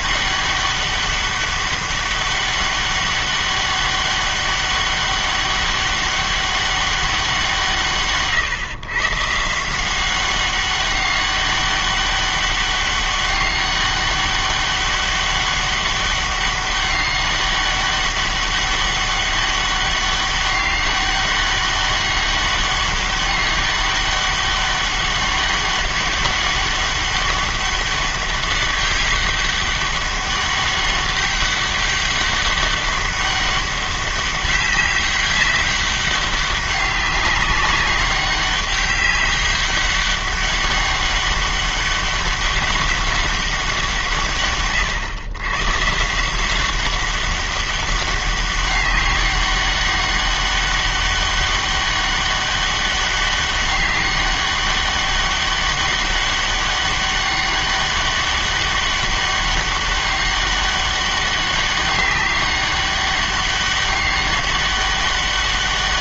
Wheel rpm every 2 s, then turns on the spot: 200, 200, 200, 200, 130, 200, 200, 200, 200, 200, 200, 200, 200, 200, 200, 200, 200, 200, 200, 200, 200, 200, 130, 190, 200, 200, 200, 200, 200, 200, 200, 200, 200.
none